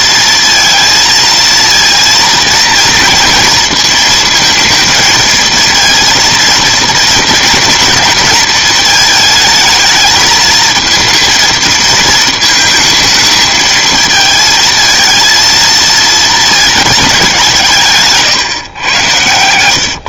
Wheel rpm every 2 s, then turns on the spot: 230, 230, 230, 230, 230, 220, 220, 220, 210, 130.
none